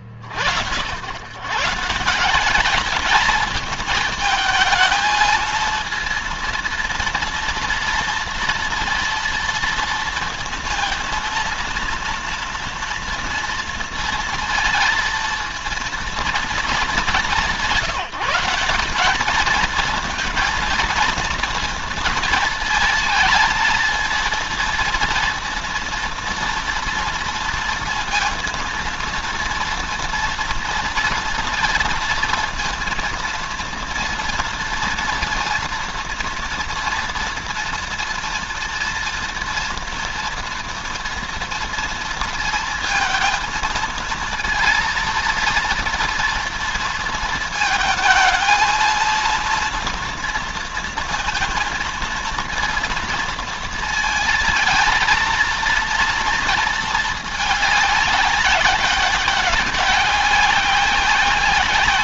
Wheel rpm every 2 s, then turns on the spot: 80, 200, 220, 230, 230, 220, 230, 230, 220, 200, 230, 230, 230, 230, 230, 240, 230, 230, 230, 230, 230, 230, 230, 230, 220, 230, 230, 220, 230, 190, 190.
none